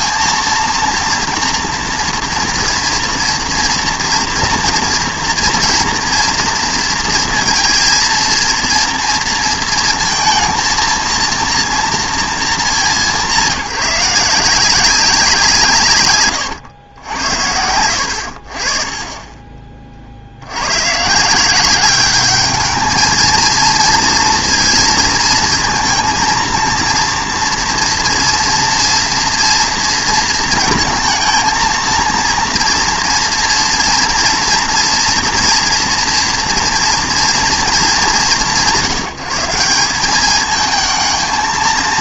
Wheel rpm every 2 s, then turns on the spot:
230, 230, 230, 230, 230, 220, 200, 180, 120, 40, 100, 220, 230, 230, 230, 230, 230, 230, 230, 160, 220.
none